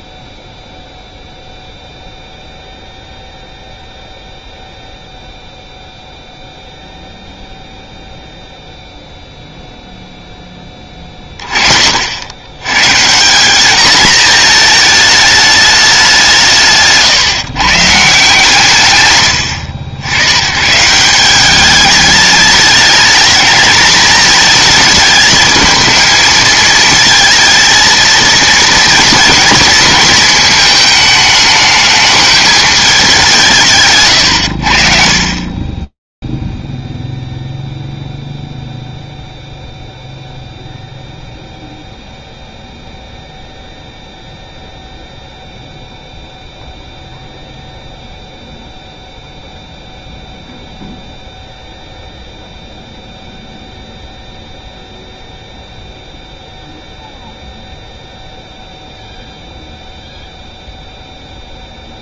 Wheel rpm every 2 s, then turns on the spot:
0, 0, 0, 0, 0, 10, 110, 220, 170, 150, 120, 210, 220, 220, 230, 230, 220, 90, 0, 0, 0, 0, 0, 0, 0, 0, 0, 0, 0, 0, 0.
none